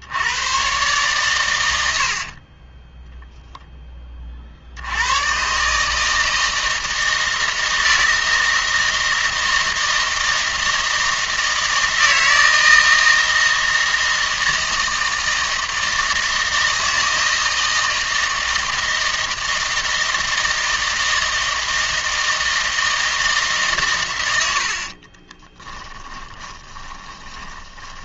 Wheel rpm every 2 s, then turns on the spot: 120, 20, 60, 160, 160, 160, 160, 160, 160, 160, 160, 160, 70, 30.
2-4 24-28